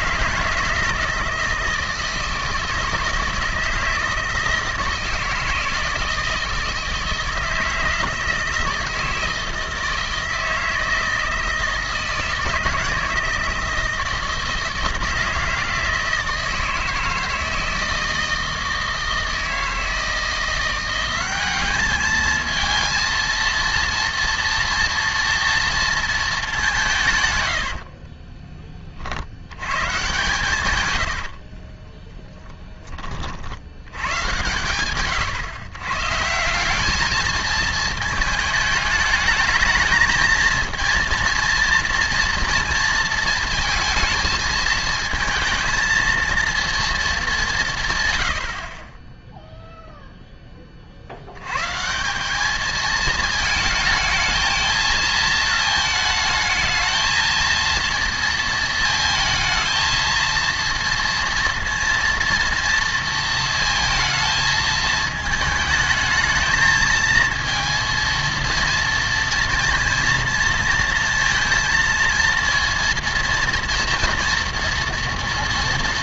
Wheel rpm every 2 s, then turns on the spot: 160, 160, 160, 160, 160, 160, 160, 160, 160, 160, 180, 230, 230, 180, 20, 110, 10, 120, 200, 220, 230, 230, 220, 230, 40, 20, 210, 220, 220, 230, 230, 230, 220, 220, 230, 230, 230, 230.
30-32